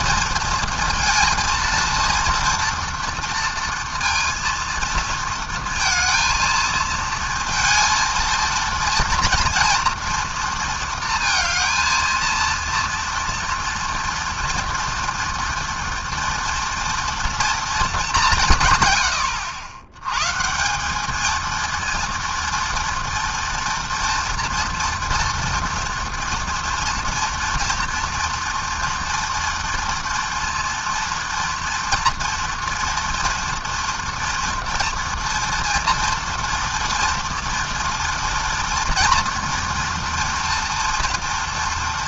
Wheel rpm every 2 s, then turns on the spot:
230, 240, 230, 230, 230, 230, 230, 230, 230, 100, 220, 230, 230, 230, 240, 230, 230, 230, 230, 240, 230.
none